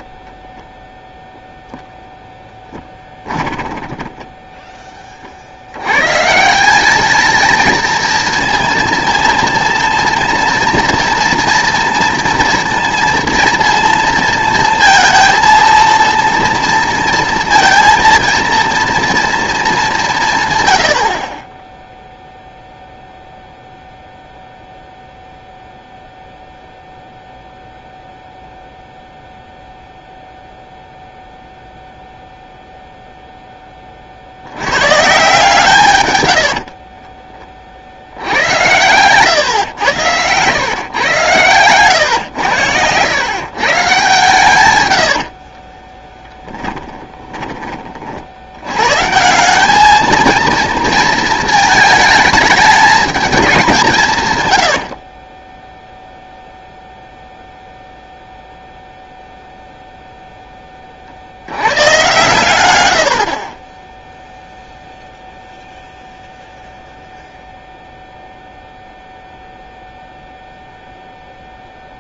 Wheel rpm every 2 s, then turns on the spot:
10, 10, 20, 190, 230, 240, 230, 230, 230, 230, 120, 0, 0, 0, 0, 0, 0, 110, 60, 100, 120, 100, 100, 10, 100, 230, 210, 100, 0, 0, 20, 110, 0, 0, 0, 0.
0-4 36-38 46-48 54-56